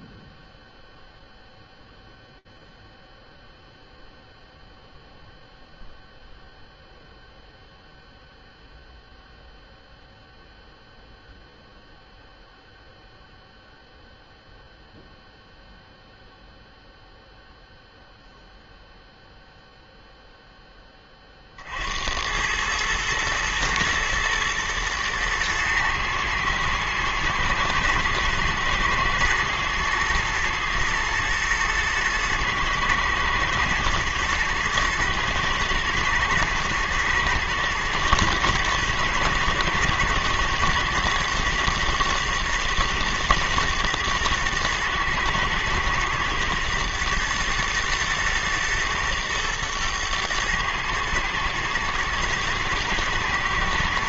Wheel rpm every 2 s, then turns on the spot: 0, 0, 0, 0, 0, 0, 0, 0, 0, 0, 40, 110, 110, 110, 110, 110, 110, 110, 110, 110, 110, 110, 110, 120, 110, 110, 110.
none